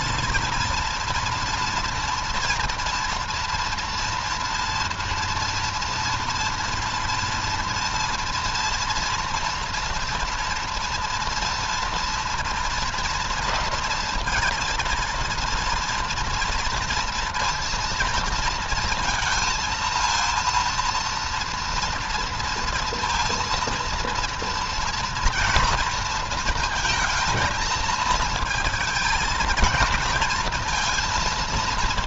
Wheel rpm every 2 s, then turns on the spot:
230, 230, 230, 240, 230, 230, 230, 230, 230, 230, 230, 230, 230, 230, 230, 230.
none